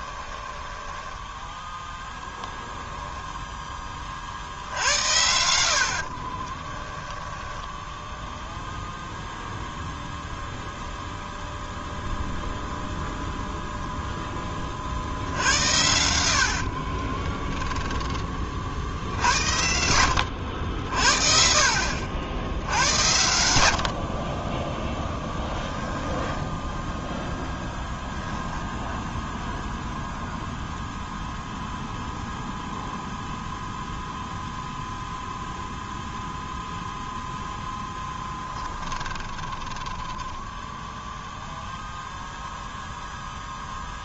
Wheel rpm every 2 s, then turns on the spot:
10, 0, 70, 20, 0, 0, 0, 40, 70, 40, 70, 80, 20, 10, 0, 0, 0, 0, 0, 20, 10, 0.
0-2 6-8 16-18 24-26 38-42